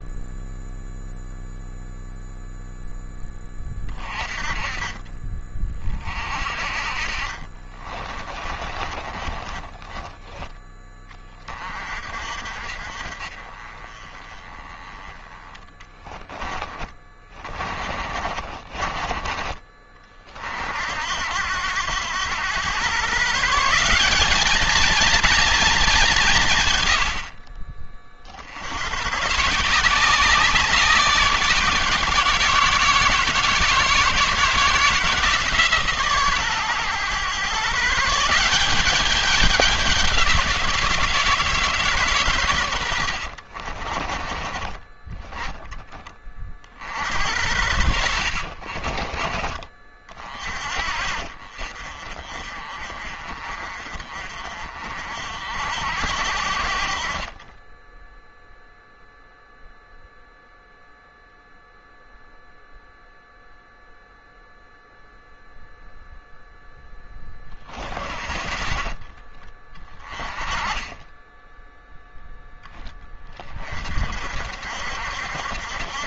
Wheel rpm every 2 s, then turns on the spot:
0, 0, 30, 30, 30, 20, 40, 20, 30, 50, 80, 130, 230, 120, 100, 190, 170, 170, 120, 200, 170, 90, 20, 50, 30, 40, 40, 50, 50, 0, 0, 0, 0, 10, 40, 20, 10, 60.
8-10 16-18 42-44 48-50 56-58 70-72